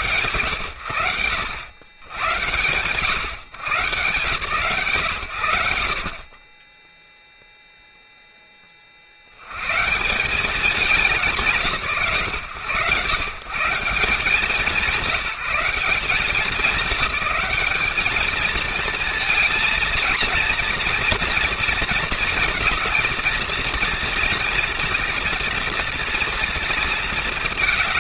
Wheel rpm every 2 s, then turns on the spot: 110, 110, 30, 0, 150, 130, 180, 200, 210, 230, 230, 230, 230, 230.
none